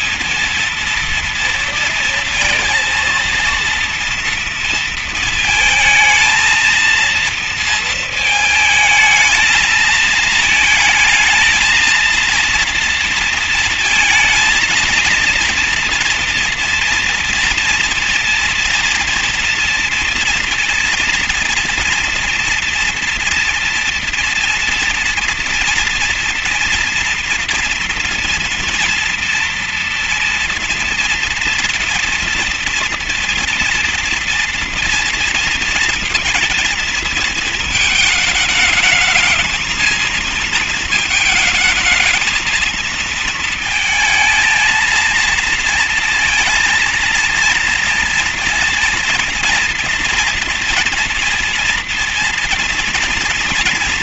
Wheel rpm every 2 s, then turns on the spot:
220, 230, 230, 220, 220, 220, 230, 230, 240, 240, 230, 230, 230, 230, 230, 230, 240, 230, 230, 220, 220, 220, 220, 230, 230, 240, 230.
none